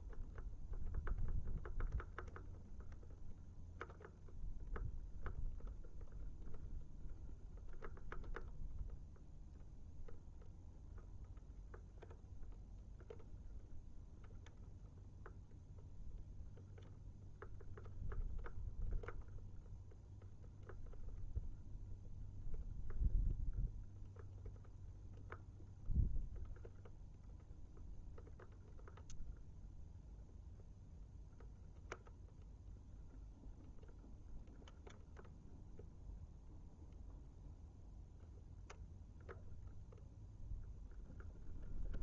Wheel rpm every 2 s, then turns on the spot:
0, 0, 0, 0, 0, 0, 0, 0, 0, 0, 0, 0, 0, 0, 0, 0, 0, 0, 0, 0, 0.
none